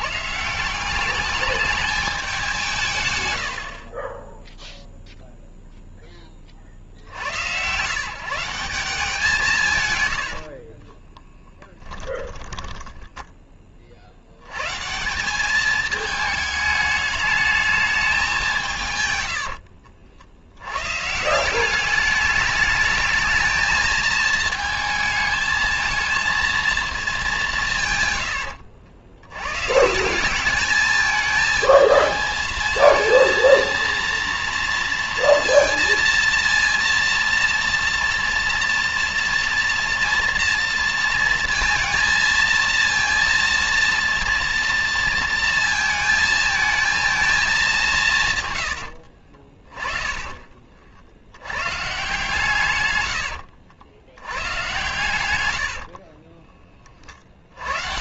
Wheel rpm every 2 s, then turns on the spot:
150, 210, 20, 20, 150, 90, 10, 120, 210, 180, 100, 210, 220, 230, 100, 210, 220, 230, 230, 230, 230, 230, 230, 220, 100, 60, 120, 110, 60.
10-14 48-50